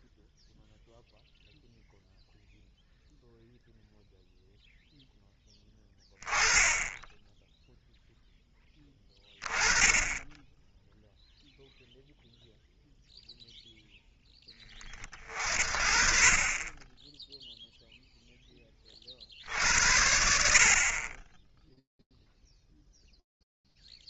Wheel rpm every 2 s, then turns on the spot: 0, 0, 0, 10, 0, 20, 0, 0, 40, 0, 60, 10.
none